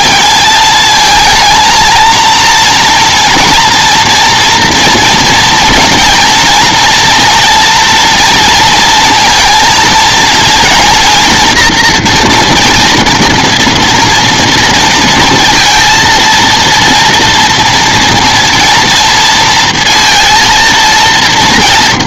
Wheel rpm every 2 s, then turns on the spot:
220, 230, 230, 230, 230, 230, 230, 230, 230, 230, 230.
none